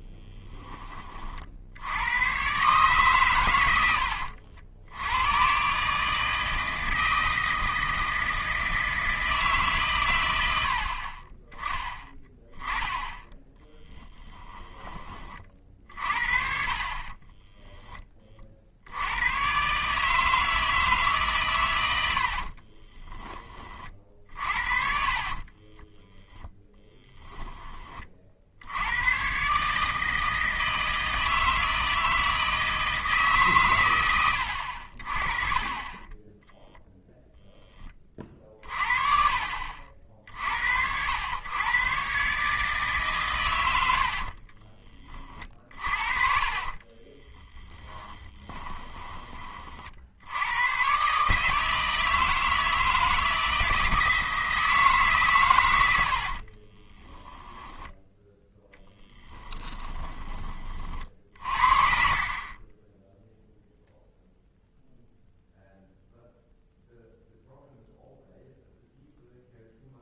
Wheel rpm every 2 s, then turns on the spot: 20, 140, 80, 160, 160, 70, 10, 10, 40, 70, 160, 30, 50, 10, 80, 160, 160, 60, 0, 50, 70, 150, 30, 30, 10, 120, 160, 160, 30, 10, 40, 10, 0, 0, 0.
14-18 22-28 46-50 56-60 62-64